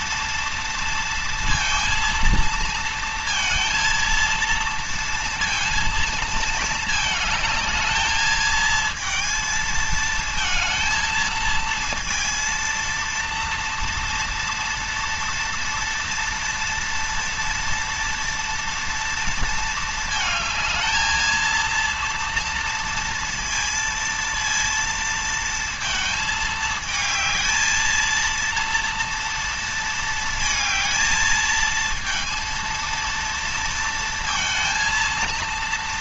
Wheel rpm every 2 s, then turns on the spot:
230, 230, 230, 220, 220, 220, 230, 230, 230, 230, 220, 230, 230, 220, 230, 220, 230, 230.
none